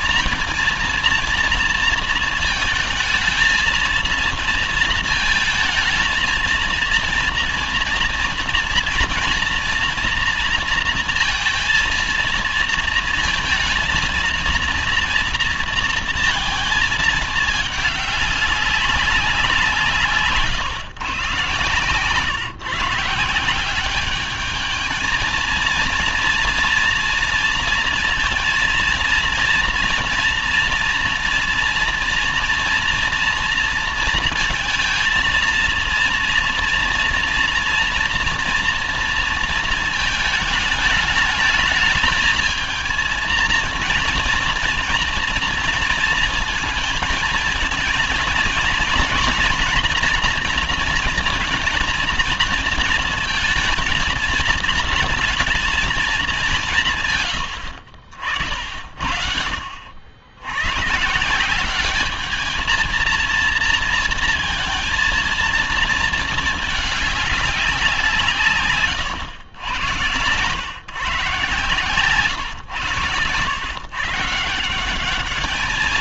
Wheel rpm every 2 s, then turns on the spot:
230, 230, 230, 230, 230, 230, 230, 230, 230, 200, 140, 140, 210, 230, 230, 230, 230, 220, 230, 230, 220, 220, 230, 230, 230, 240, 230, 220, 190, 60, 90, 220, 230, 220, 140, 130, 120, 160.
none